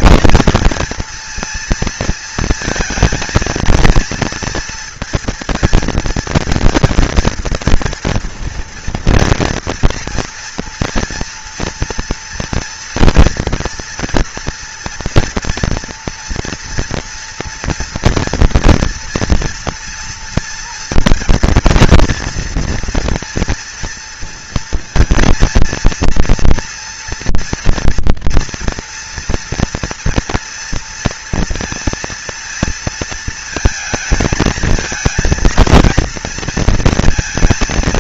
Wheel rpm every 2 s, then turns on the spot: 230, 230, 230, 230, 230, 230, 240, 230, 230, 230, 230, 230, 230, 230, 230, 230, 230, 220, 230.
none